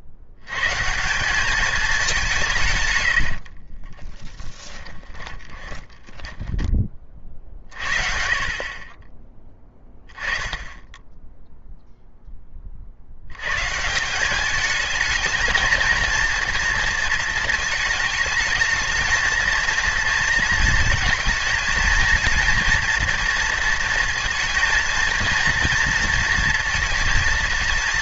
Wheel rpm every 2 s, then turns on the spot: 140, 130, 20, 30, 20, 10, 50, 220, 230, 220, 230, 230, 230, 230.
4-6